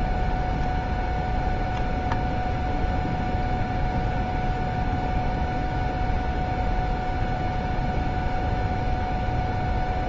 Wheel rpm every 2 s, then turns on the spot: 0, 0, 0, 0, 0.
none